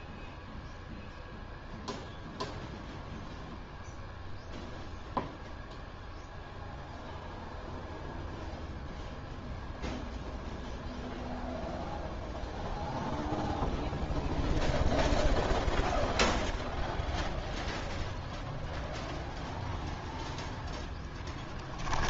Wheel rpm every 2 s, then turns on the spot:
0, 0, 0, 0, 0, 0, 0, 0, 0, 0, 0.
none